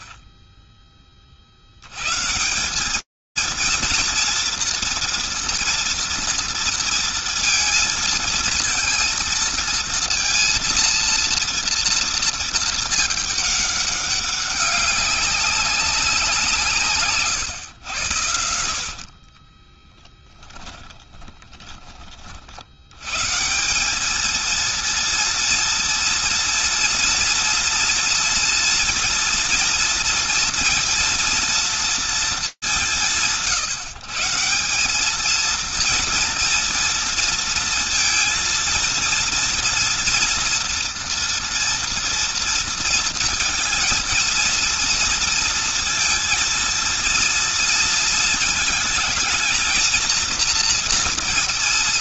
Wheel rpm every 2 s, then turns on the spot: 0, 80, 230, 230, 220, 230, 220, 200, 180, 90, 10, 70, 230, 230, 230, 230, 150, 190, 230, 230, 230, 230, 230, 230, 220, 230.
20-22